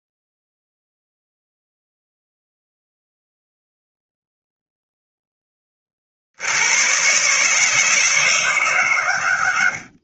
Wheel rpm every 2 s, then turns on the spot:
0, 0, 0, 60, 160.
none